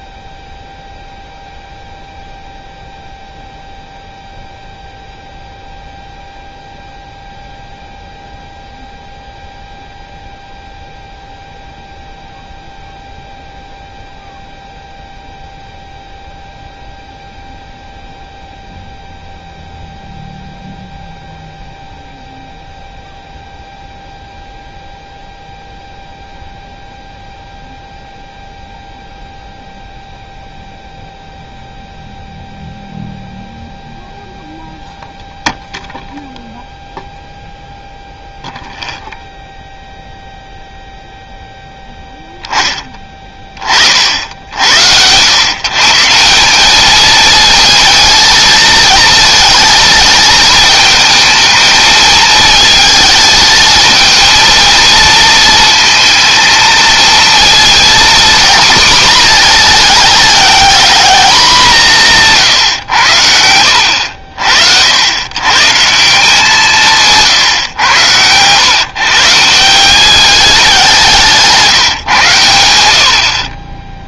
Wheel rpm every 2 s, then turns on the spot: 0, 0, 0, 0, 0, 0, 0, 0, 0, 0, 0, 0, 0, 0, 0, 0, 0, 10, 0, 0, 0, 10, 80, 190, 220, 220, 220, 230, 220, 230, 210, 130, 60, 180, 130, 200, 90.
none